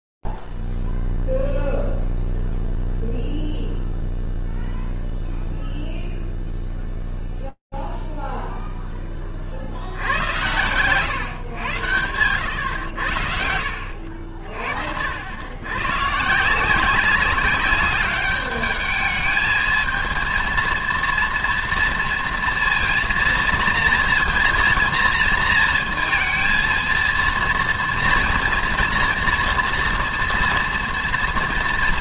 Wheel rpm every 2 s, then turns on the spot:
0, 0, 0, 0, 0, 110, 110, 60, 180, 210, 230, 230, 230, 230, 230, 230.
none